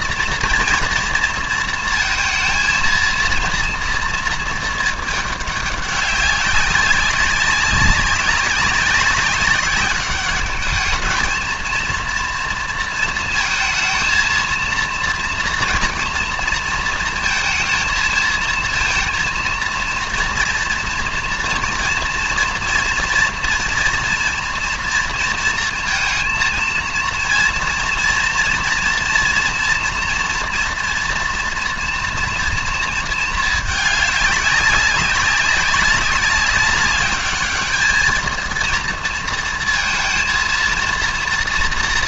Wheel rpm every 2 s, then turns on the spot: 230, 230, 220, 200, 190, 210, 230, 230, 230, 230, 240, 230, 230, 230, 230, 230, 230, 200, 200, 230, 230.
none